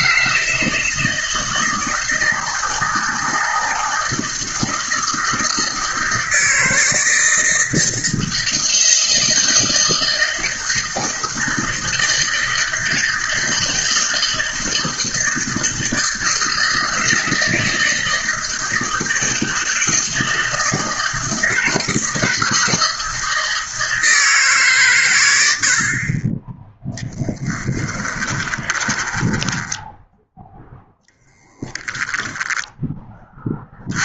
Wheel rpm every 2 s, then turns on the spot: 160, 160, 160, 160, 160, 160, 160, 160, 160, 160, 160, 160, 120, 0, 10, 0, 10.
28-30